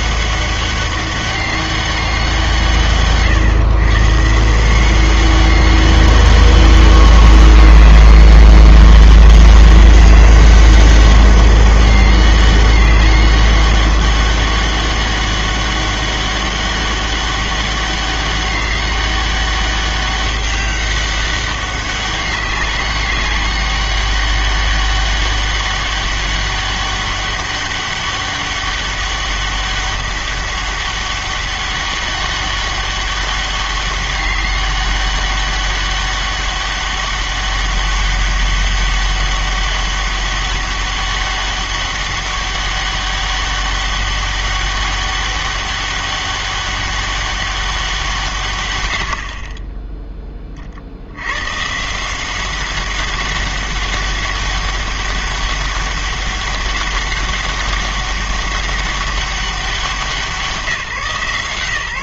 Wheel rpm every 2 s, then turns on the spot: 200, 140, 180, 200, 200, 200, 200, 200, 200, 200, 200, 200, 200, 200, 200, 200, 200, 200, 200, 200, 200, 200, 200, 200, 110, 40, 190, 200, 200, 200, 160.
none